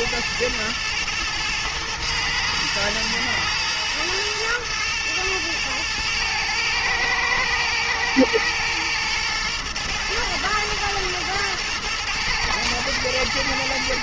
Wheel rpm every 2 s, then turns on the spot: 110, 110, 120, 110, 110, 110, 110.
none